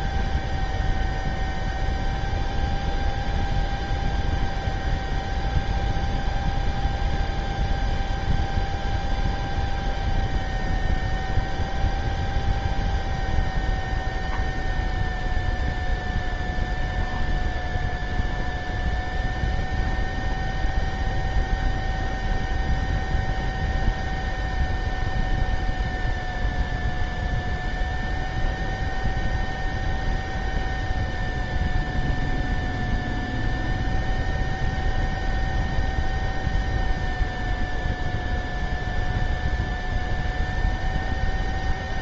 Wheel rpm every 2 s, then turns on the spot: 0, 0, 0, 0, 0, 0, 0, 0, 0, 0, 0, 0, 0, 0, 0, 0, 0, 0, 0, 0, 0.
none